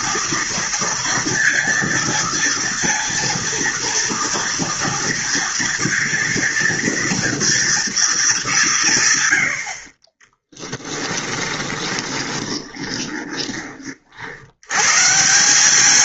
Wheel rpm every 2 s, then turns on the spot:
230, 230, 240, 240, 180, 10, 20, 110.
10-14